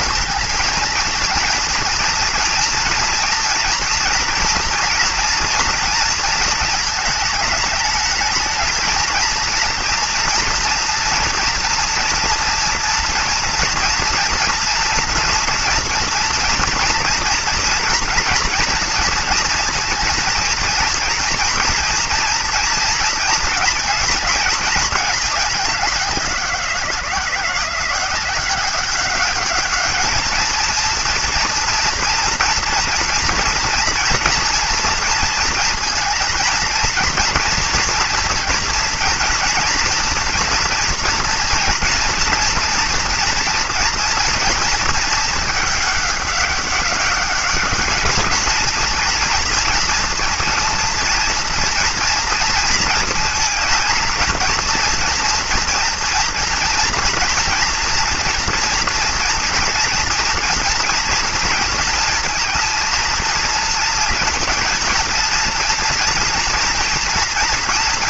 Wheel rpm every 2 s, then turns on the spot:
230, 230, 240, 220, 220, 240, 230, 230, 230, 230, 220, 230, 220, 180, 190, 230, 230, 230, 230, 230, 240, 230, 230, 200, 230, 230, 230, 230, 230, 230, 230, 230, 230, 230.
none